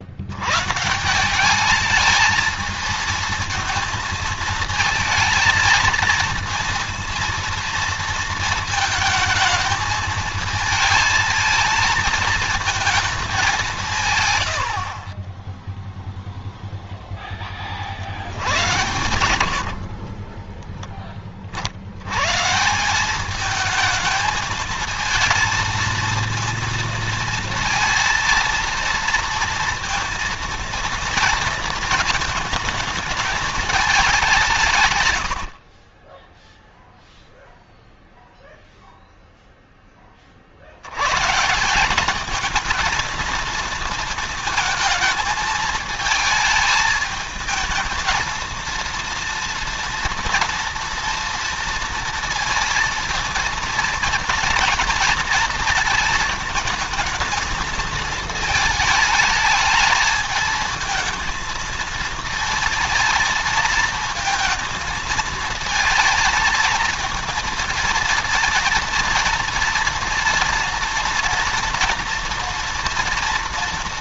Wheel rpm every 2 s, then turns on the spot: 100, 210, 220, 230, 220, 220, 220, 90, 0, 100, 20, 140, 220, 230, 230, 230, 220, 160, 0, 0, 50, 220, 230, 220, 230, 230, 230, 230, 220, 220, 220, 230, 230, 220, 230, 230, 230.
14-16 18-22